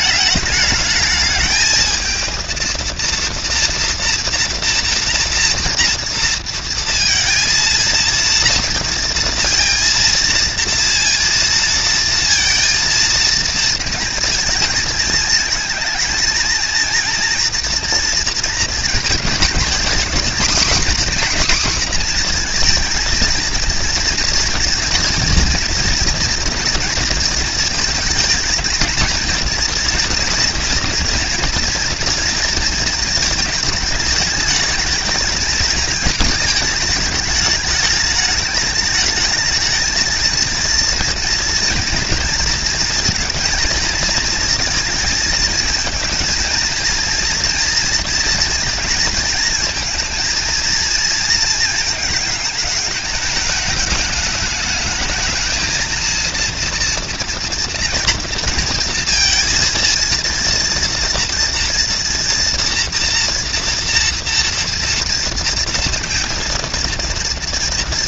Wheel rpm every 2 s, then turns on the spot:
210, 230, 230, 230, 230, 230, 230, 220, 230, 230, 250, 230, 240, 230, 230, 230, 220, 220, 220, 210, 230, 230, 230, 230, 230, 230, 210, 220, 230, 230, 230, 230, 230, 230.
none